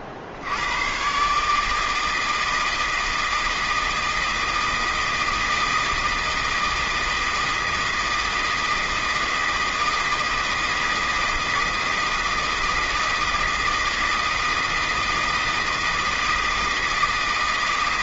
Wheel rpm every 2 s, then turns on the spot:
100, 160, 160, 160, 160, 160, 160, 160, 160.
none